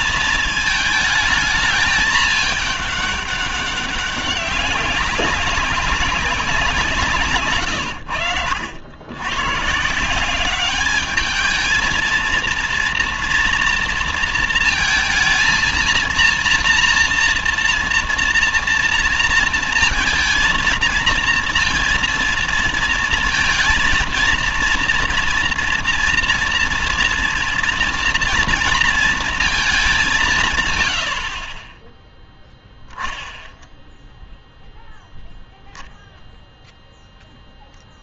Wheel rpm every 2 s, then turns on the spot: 220, 210, 190, 190, 80, 190, 230, 230, 230, 230, 230, 230, 230, 230, 230, 130, 0, 0, 0.
none